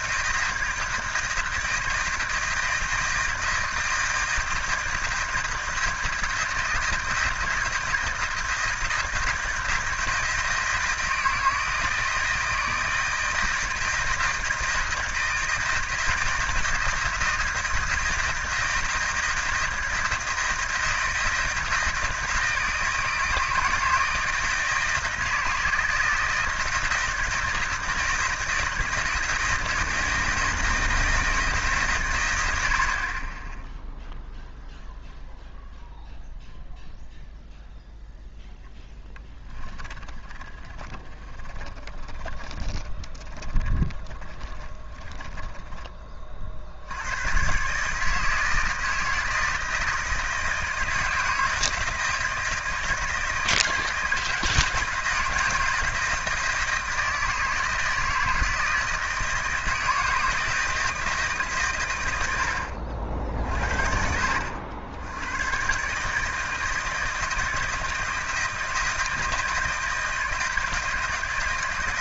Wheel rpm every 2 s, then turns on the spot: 160, 160, 160, 160, 160, 170, 160, 160, 160, 160, 160, 160, 160, 170, 160, 160, 60, 0, 0, 0, 20, 20, 20, 60, 160, 160, 160, 160, 160, 160, 160, 60, 80, 160, 160, 160.
40-46